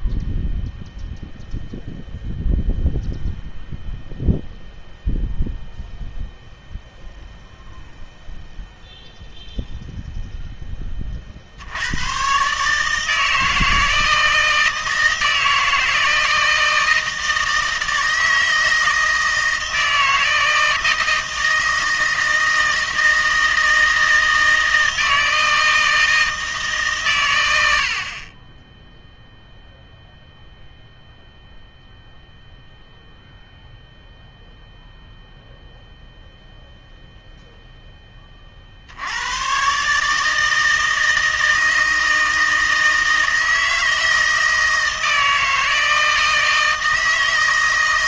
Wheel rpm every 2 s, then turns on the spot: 0, 0, 0, 0, 0, 10, 140, 160, 160, 160, 160, 160, 160, 150, 10, 0, 0, 0, 0, 50, 160, 160, 160, 160.
none